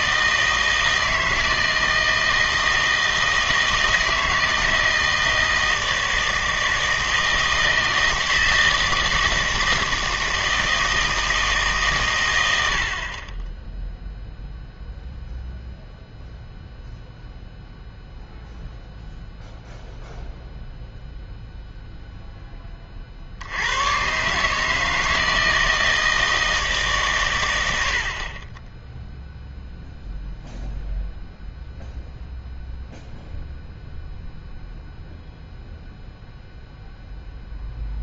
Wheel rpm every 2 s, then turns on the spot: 160, 160, 160, 160, 160, 160, 80, 0, 0, 0, 0, 20, 150, 160, 20, 0, 0, 0, 0.
none